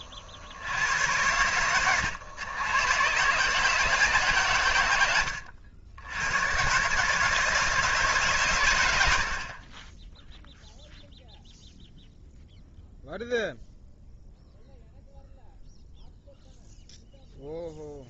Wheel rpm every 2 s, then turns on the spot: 50, 110, 100, 130, 110, 0, 0, 0, 0.
none